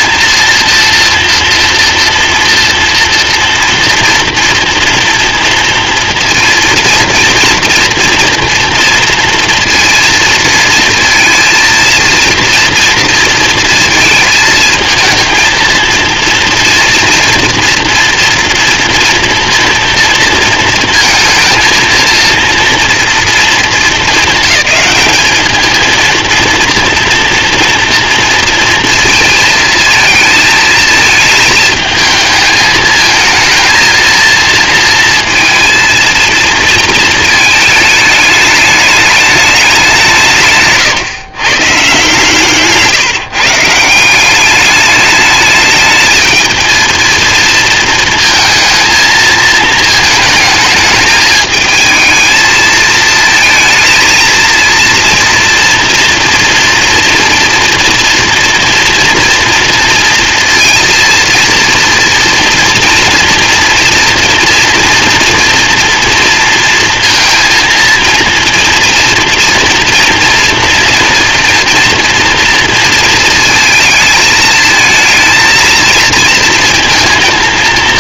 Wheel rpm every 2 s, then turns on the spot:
230, 230, 230, 230, 230, 230, 230, 230, 230, 230, 230, 230, 220, 230, 230, 220, 220, 230, 230, 210, 140, 140, 200, 220, 230, 220, 220, 230, 230, 230, 230, 230, 240, 230, 230, 230, 230, 220, 230.
42-44